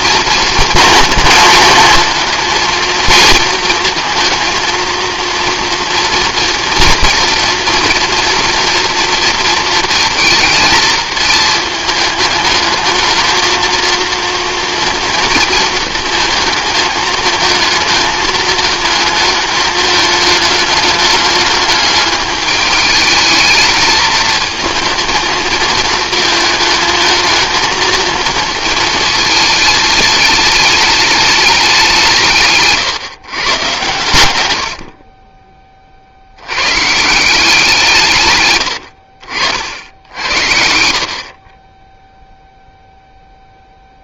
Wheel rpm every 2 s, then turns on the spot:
230, 220, 230, 230, 230, 230, 220, 230, 220, 220, 210, 210, 220, 220, 220, 220, 150, 70, 120, 100, 50, 0.
none